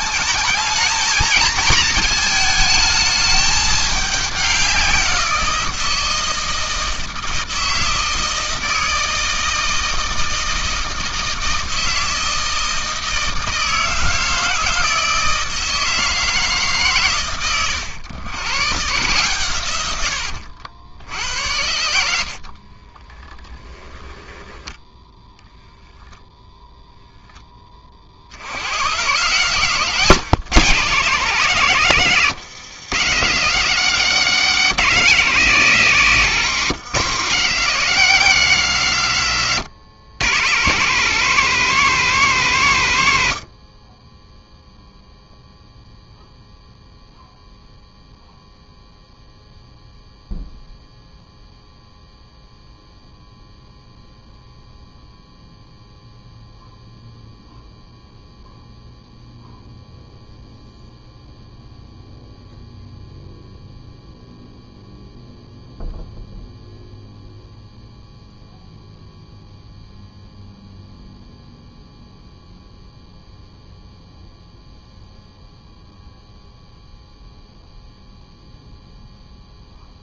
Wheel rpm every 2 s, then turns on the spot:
220, 220, 180, 160, 160, 160, 160, 160, 130, 120, 70, 30, 10, 0, 120, 160, 140, 180, 160, 150, 170, 120, 0, 0, 0, 0, 0, 0, 0, 0, 0, 0, 0, 0, 0, 0, 0, 0, 0, 0.
22-24